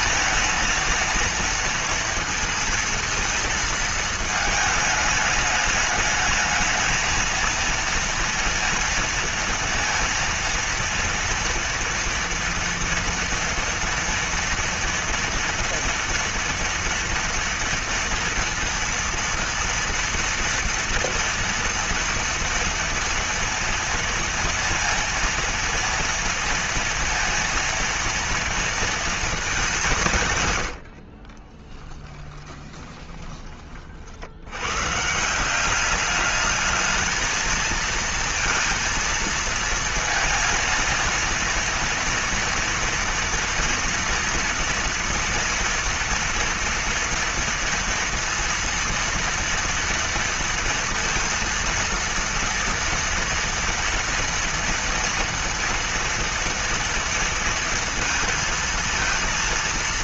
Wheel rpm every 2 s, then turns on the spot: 230, 230, 220, 210, 230, 230, 230, 240, 230, 230, 230, 230, 230, 230, 230, 130, 10, 100, 210, 230, 230, 240, 230, 230, 230, 230, 230, 230, 230, 220.
30-34